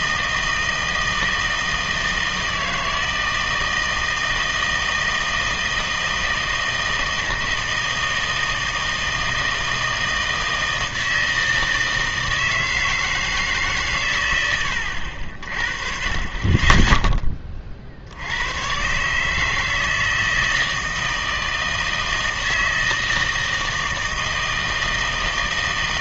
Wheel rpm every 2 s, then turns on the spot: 160, 160, 160, 160, 160, 160, 160, 90, 20, 120, 160, 160, 160.
none